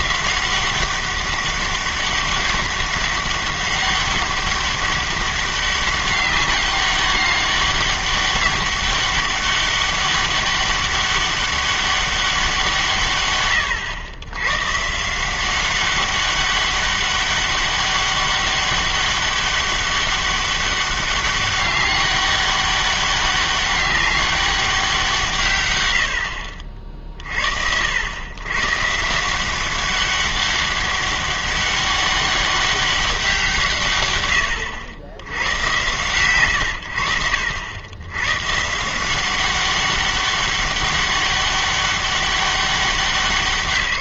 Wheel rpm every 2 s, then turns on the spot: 190, 200, 200, 190, 200, 200, 170, 120, 200, 200, 200, 200, 190, 50, 130, 200, 200, 100, 110, 150, 200, 190.
none